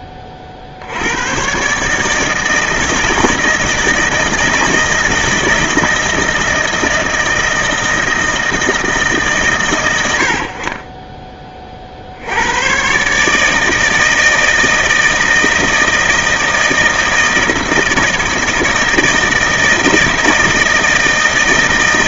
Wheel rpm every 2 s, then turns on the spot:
60, 160, 160, 160, 160, 60, 120, 160, 160, 160, 160.
none